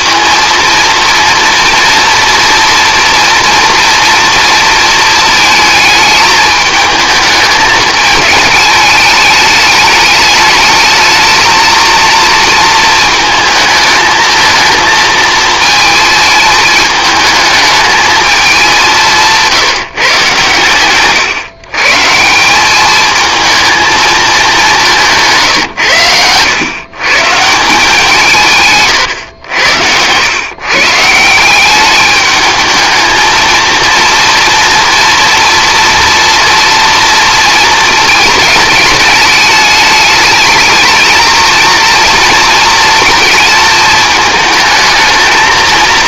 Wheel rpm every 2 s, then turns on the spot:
230, 240, 230, 220, 210, 220, 230, 220, 220, 190, 130, 190, 190, 120, 130, 130, 220, 230, 230, 220, 220, 230, 220.
none